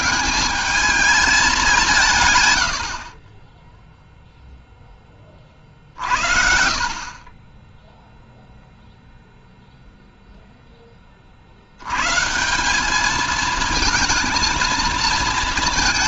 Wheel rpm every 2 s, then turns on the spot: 210, 100, 0, 40, 0, 0, 170, 230.
none